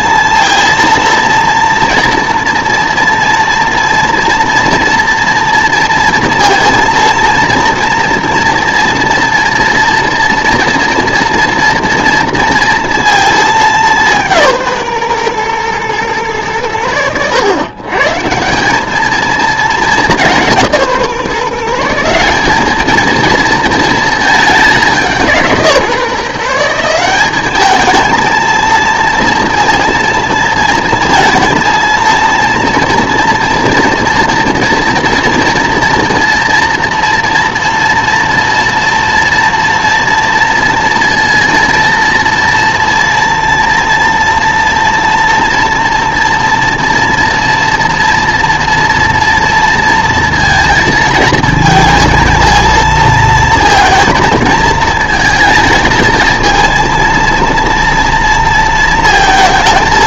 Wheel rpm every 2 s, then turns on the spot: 230, 230, 230, 230, 230, 230, 230, 150, 90, 180, 170, 210, 200, 170, 230, 230, 230, 230, 230, 230, 230, 230, 230, 230, 230, 230, 220, 220, 230, 230.
none